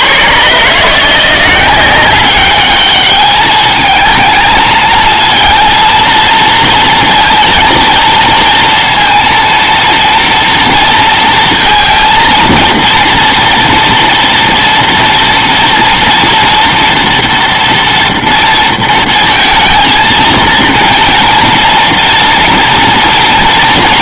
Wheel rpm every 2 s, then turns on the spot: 130, 200, 220, 230, 230, 230, 230, 230, 230, 230, 230, 230.
none